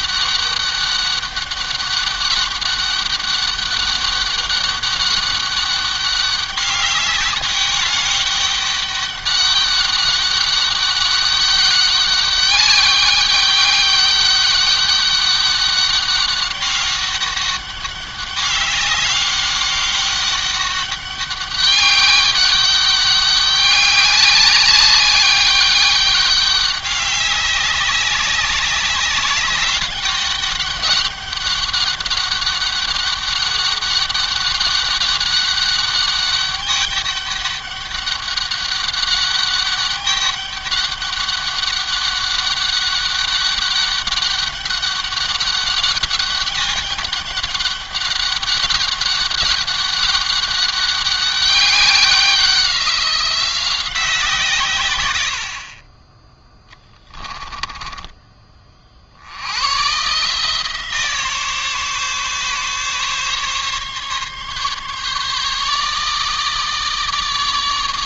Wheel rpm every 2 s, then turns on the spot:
200, 200, 200, 200, 200, 200, 200, 200, 200, 200, 200, 200, 200, 200, 200, 200, 200, 200, 200, 200, 200, 200, 190, 200, 200, 200, 180, 130, 20, 40, 150, 140, 140, 160.
56-58